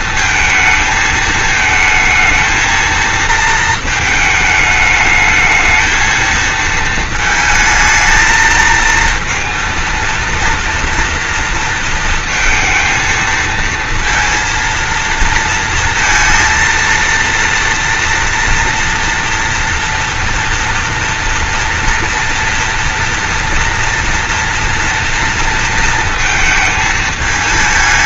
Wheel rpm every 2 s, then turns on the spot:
220, 220, 220, 230, 220, 230, 220, 230, 230, 230, 230, 230, 230, 220.
none